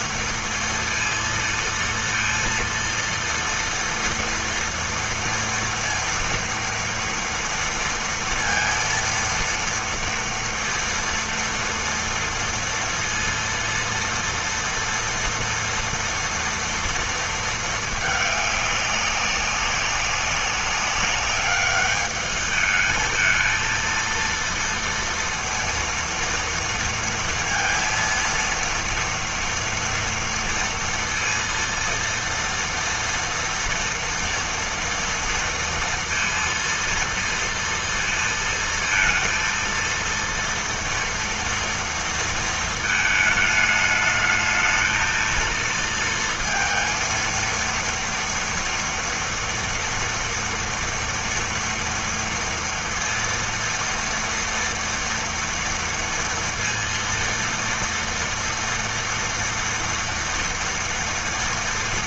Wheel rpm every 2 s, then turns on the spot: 230, 230, 230, 230, 230, 230, 230, 230, 230, 210, 200, 210, 230, 230, 230, 230, 230, 240, 230, 230, 230, 230, 220, 230, 230, 230, 230, 230, 230, 230, 230.
none